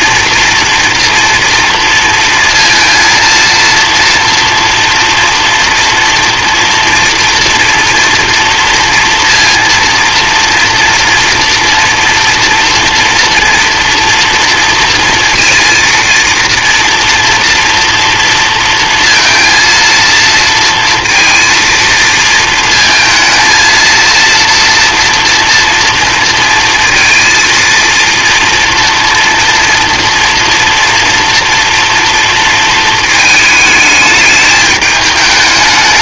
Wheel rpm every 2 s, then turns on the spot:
230, 230, 230, 230, 230, 230, 230, 230, 230, 230, 230, 230, 230, 230, 240, 230, 220, 210.
none